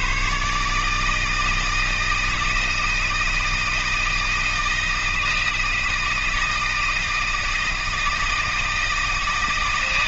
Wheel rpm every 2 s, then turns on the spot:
80, 160, 160, 160, 160.
none